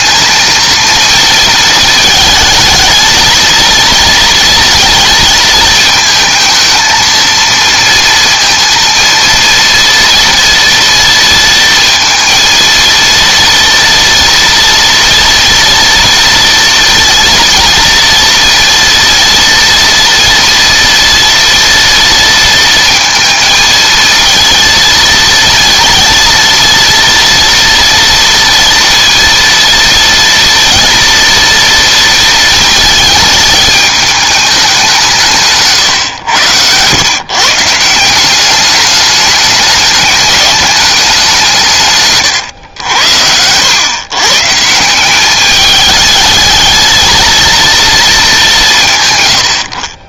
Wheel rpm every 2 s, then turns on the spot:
230, 220, 230, 220, 230, 230, 230, 240, 230, 230, 230, 230, 230, 230, 230, 230, 220, 200, 120, 200, 210, 110, 160, 220, 170.
none